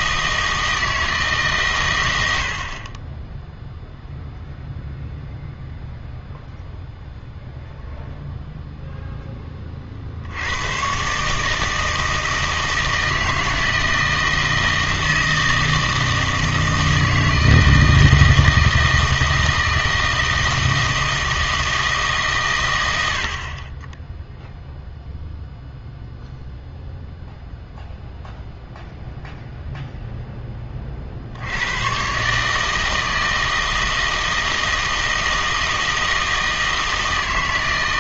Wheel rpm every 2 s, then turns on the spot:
160, 50, 0, 0, 0, 110, 160, 160, 160, 160, 160, 100, 0, 0, 0, 20, 160, 160, 160.
none